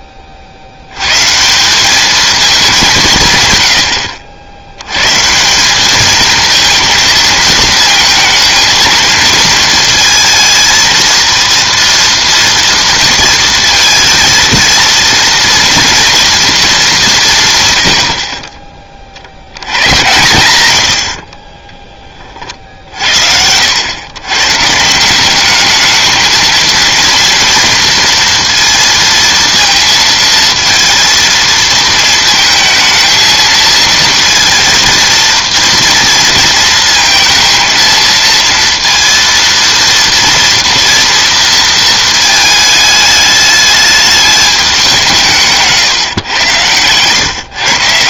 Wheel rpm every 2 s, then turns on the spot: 50, 210, 90, 220, 220, 230, 230, 230, 220, 30, 90, 60, 170, 220, 230, 230, 220, 230, 230, 230, 230, 210, 190, 120.
none